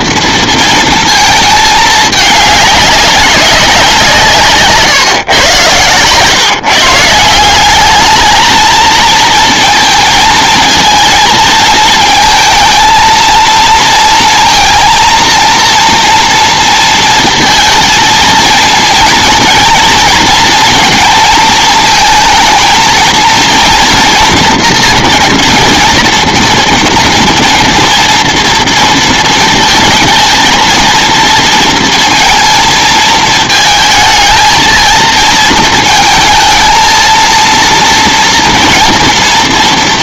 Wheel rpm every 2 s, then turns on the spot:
230, 210, 140, 150, 220, 220, 220, 230, 230, 230, 230, 230, 230, 240, 230, 220, 220, 230, 230, 230.
none